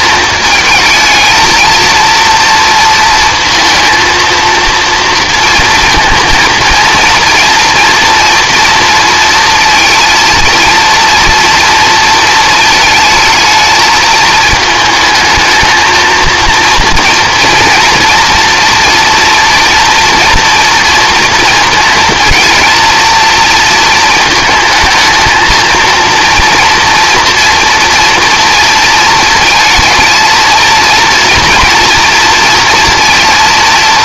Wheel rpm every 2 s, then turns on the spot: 230, 230, 230, 230, 230, 230, 220, 220, 230, 240, 230, 230, 220, 230, 230, 230, 230.
none